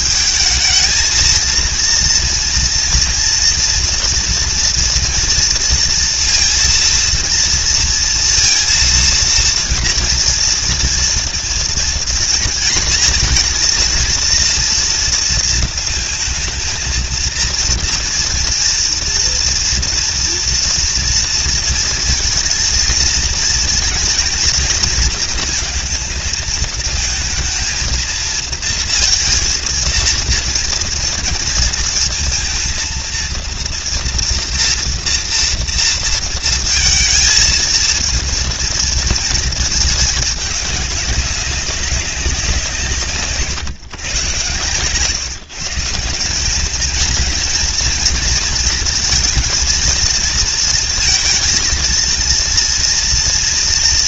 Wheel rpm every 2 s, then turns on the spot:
210, 230, 230, 230, 230, 230, 230, 230, 220, 230, 230, 220, 230, 220, 230, 230, 230, 240, 230, 230, 210, 170, 130, 210, 230, 230, 230.
none